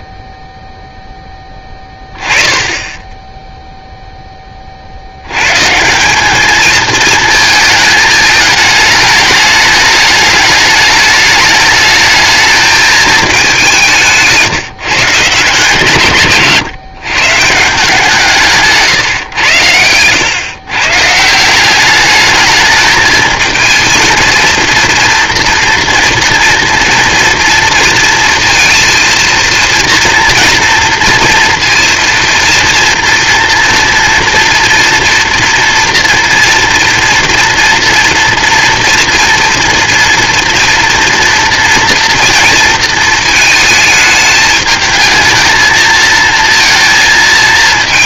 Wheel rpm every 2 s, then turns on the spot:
0, 10, 10, 210, 220, 210, 220, 160, 140, 160, 130, 210, 230, 230, 230, 230, 230, 230, 230, 240, 230, 230, 210, 230.
none